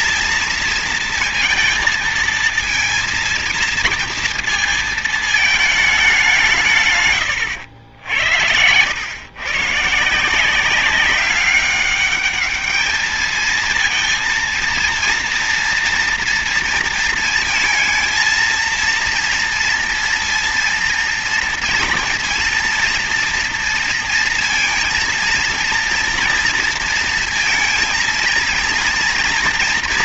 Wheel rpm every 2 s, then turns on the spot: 230, 220, 230, 170, 80, 170, 210, 230, 230, 230, 230, 230, 230, 230, 230.
none